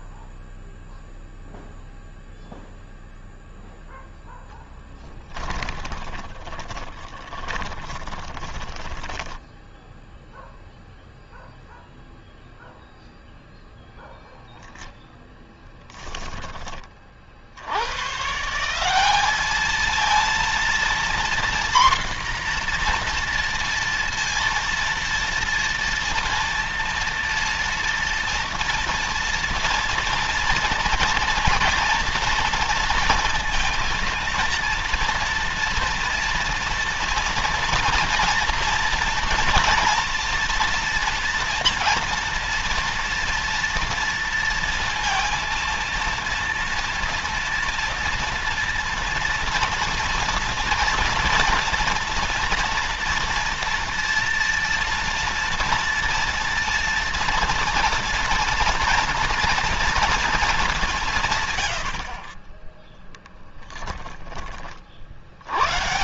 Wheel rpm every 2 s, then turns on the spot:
0, 0, 10, 20, 20, 0, 0, 0, 20, 160, 230, 240, 230, 230, 230, 230, 230, 230, 230, 240, 240, 230, 230, 230, 230, 230, 240, 230, 230, 230, 210, 30, 20.
4-10